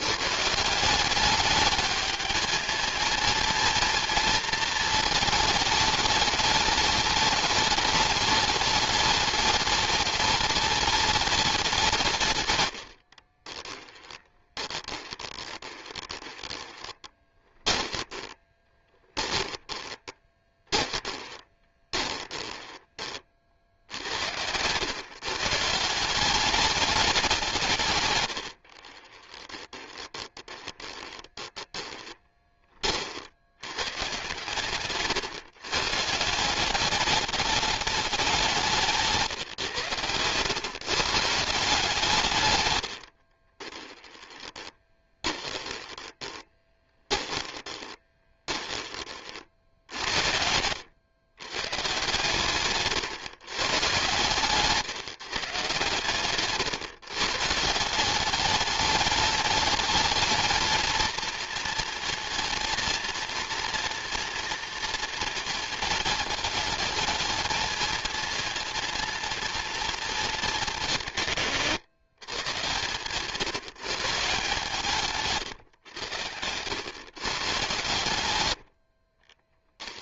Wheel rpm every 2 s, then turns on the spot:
160, 220, 220, 210, 210, 210, 90, 20, 20, 20, 20, 20, 110, 200, 40, 30, 30, 120, 190, 170, 130, 100, 20, 20, 20, 90, 140, 150, 140, 210, 220, 230, 230, 220, 230, 190, 140, 150, 100, 70.
14-22 28-32 44-48